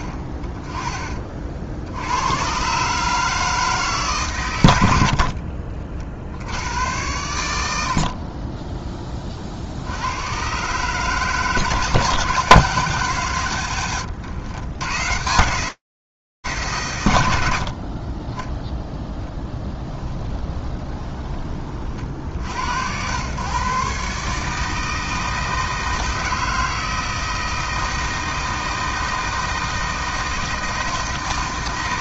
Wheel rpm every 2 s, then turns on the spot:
40, 120, 110, 80, 20, 120, 150, 110, 90, 0, 20, 100, 160, 160, 160, 160.
20-22